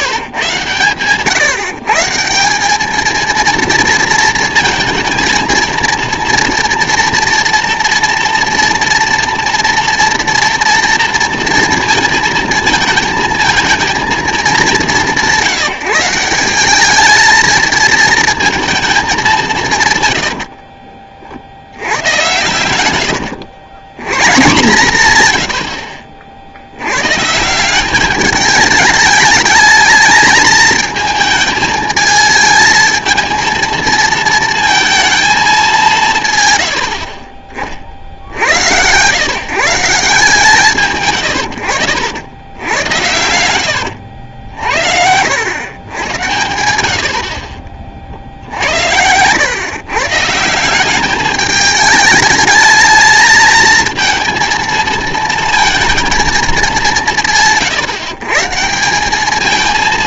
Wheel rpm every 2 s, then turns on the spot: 120, 200, 230, 230, 230, 230, 220, 200, 200, 220, 50, 100, 160, 80, 210, 220, 220, 220, 90, 100, 150, 100, 70, 90, 90, 180, 220, 230, 200, 170.
20-22 46-50